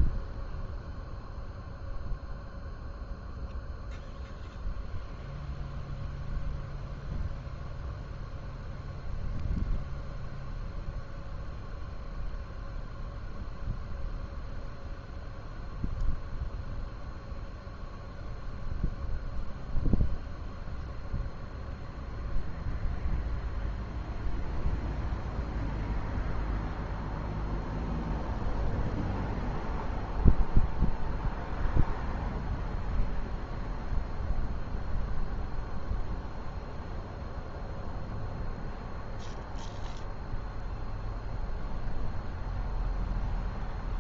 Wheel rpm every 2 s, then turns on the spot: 0, 0, 0, 0, 0, 0, 0, 0, 0, 0, 0, 0, 0, 0, 0, 0, 0, 0, 0, 0, 0, 0.
none